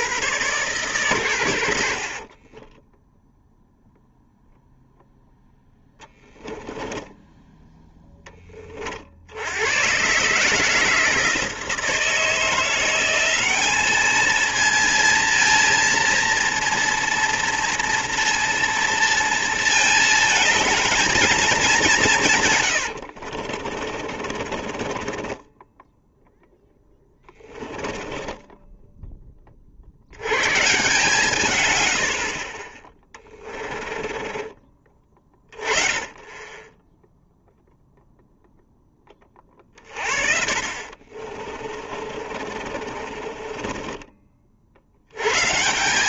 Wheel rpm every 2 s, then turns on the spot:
130, 20, 0, 10, 30, 160, 170, 230, 230, 230, 220, 120, 40, 10, 10, 130, 20, 20, 10, 10, 50, 40, 50.
2-4 6-8 22-30 40-44